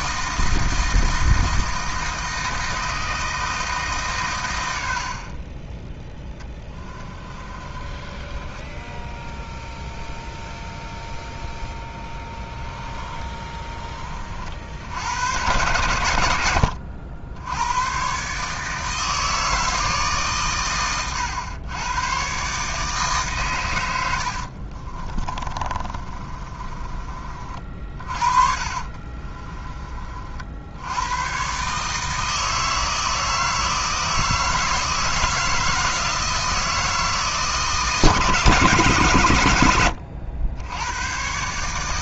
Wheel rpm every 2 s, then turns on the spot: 160, 160, 90, 20, 10, 0, 10, 70, 80, 150, 120, 150, 40, 30, 40, 80, 160, 160, 160, 150, 80.
6-10 12-14 24-30